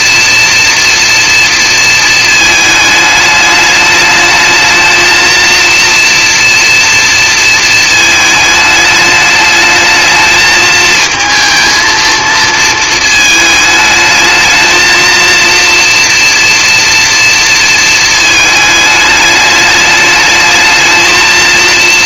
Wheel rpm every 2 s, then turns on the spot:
230, 210, 220, 230, 210, 220, 220, 230, 230, 210, 220.
none